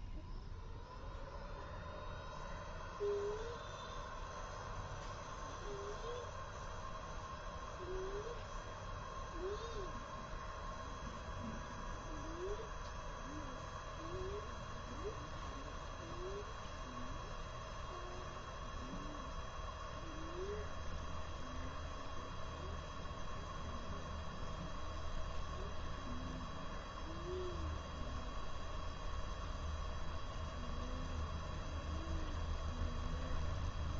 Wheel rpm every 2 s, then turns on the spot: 0, 0, 0, 0, 0, 0, 0, 0, 0, 0, 0, 0, 0, 0, 0, 0, 0.
none